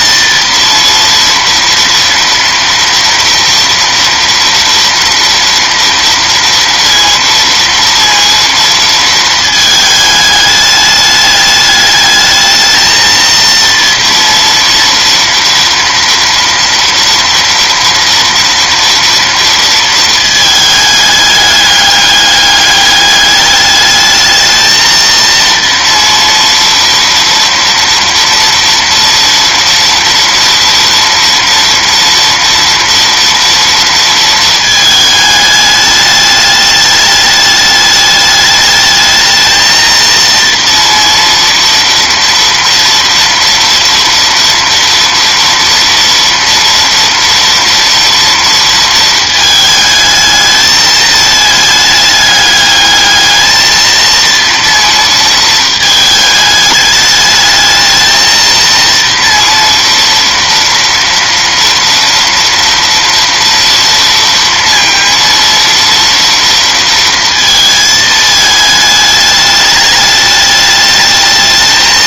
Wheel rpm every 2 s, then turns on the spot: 230, 230, 230, 230, 230, 210, 230, 230, 230, 230, 210, 200, 230, 230, 230, 230, 230, 220, 210, 210, 230, 230, 230, 230, 220, 220, 220, 230, 210, 230, 230, 230, 230, 230, 210, 220.
none